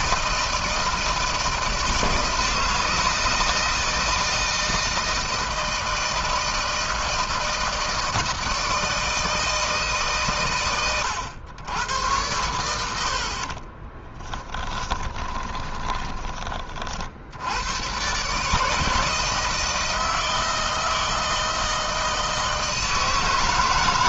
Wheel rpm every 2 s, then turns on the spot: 160, 160, 160, 160, 160, 120, 90, 20, 50, 160, 160, 160.
12-16